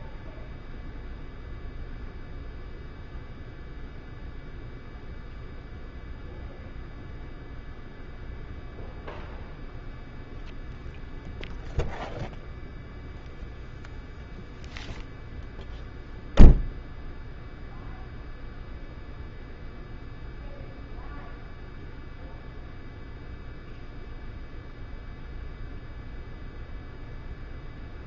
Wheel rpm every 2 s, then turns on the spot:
0, 0, 0, 0, 0, 0, 0, 0, 0, 0, 0, 0, 0, 0.
none